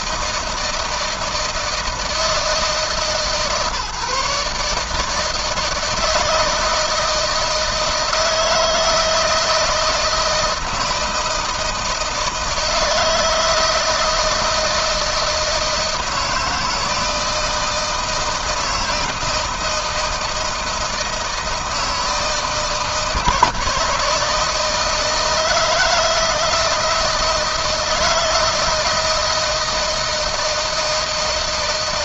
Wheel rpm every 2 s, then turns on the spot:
160, 140, 150, 160, 160, 160, 160, 160, 160, 160, 160, 160, 160, 160, 160, 160.
none